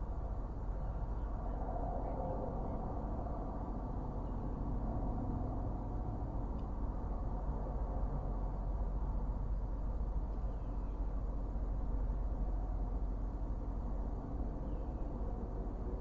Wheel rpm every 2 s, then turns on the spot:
0, 0, 0, 0, 0, 0, 0, 0.
none